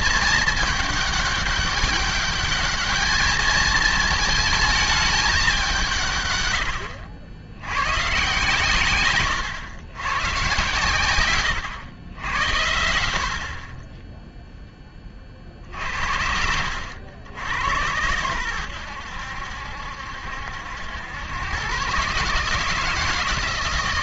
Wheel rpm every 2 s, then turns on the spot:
220, 210, 220, 110, 140, 120, 90, 10, 80, 100, 80, 160.
none